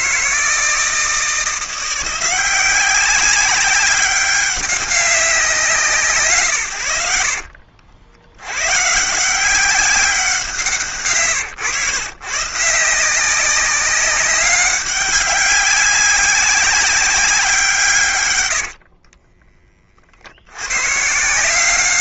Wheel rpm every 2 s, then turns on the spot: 170, 190, 200, 100, 130, 160, 160, 200, 190, 70, 120.
18-20